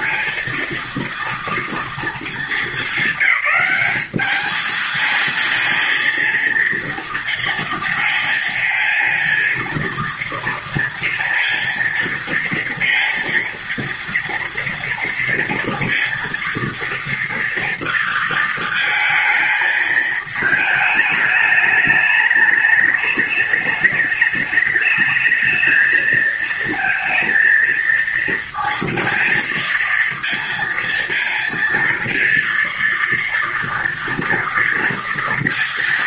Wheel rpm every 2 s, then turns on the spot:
230, 220, 220, 230, 230, 230, 230, 230, 230, 230, 220, 210, 210, 220, 230, 230, 230, 230.
none